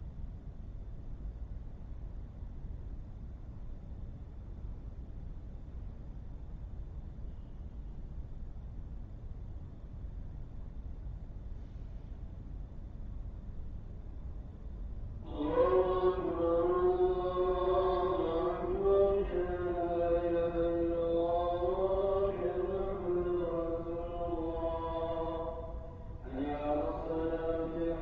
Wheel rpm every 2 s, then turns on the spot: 0, 0, 0, 0, 0, 0, 0, 0, 0, 0, 0, 0, 0, 0.
none